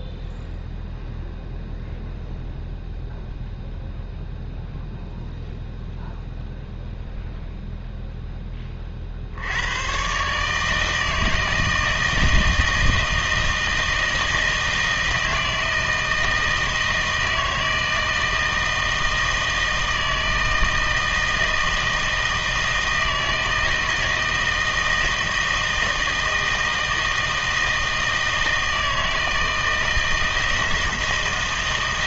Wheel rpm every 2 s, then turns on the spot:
0, 0, 0, 0, 20, 150, 160, 160, 160, 160, 160, 160, 160, 160, 160, 160.
none